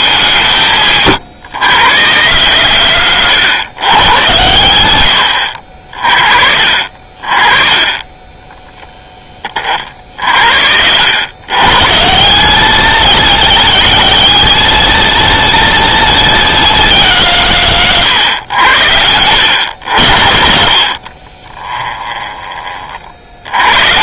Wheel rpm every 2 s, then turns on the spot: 130, 70, 50, 20, 0, 40, 110, 110, 100, 50, 20, 20.
none